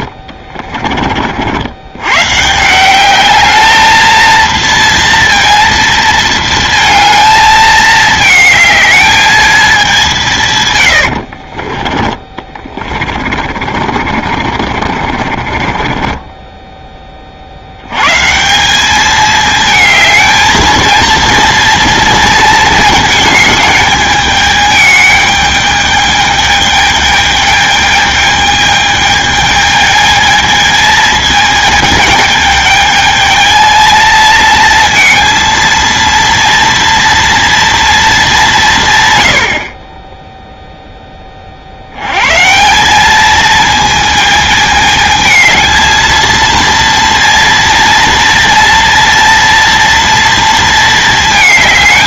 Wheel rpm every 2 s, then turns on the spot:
30, 160, 230, 230, 220, 110, 20, 40, 10, 190, 220, 230, 210, 210, 210, 220, 220, 230, 230, 170, 0, 160, 220, 230, 230, 230.
12-16